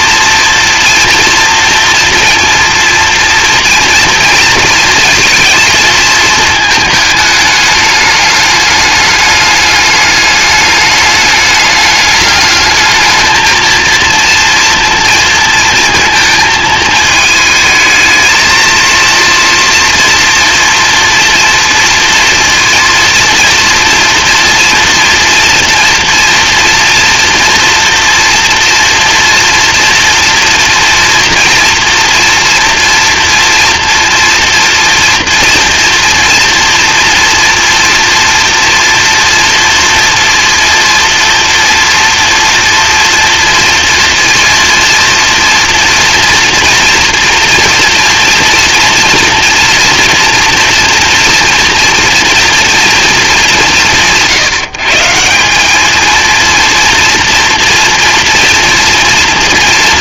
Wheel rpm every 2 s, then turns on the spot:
230, 230, 230, 220, 210, 210, 210, 230, 220, 230, 230, 230, 240, 230, 230, 230, 230, 240, 230, 230, 230, 230, 230, 230, 230, 230, 230, 150, 230, 230.
none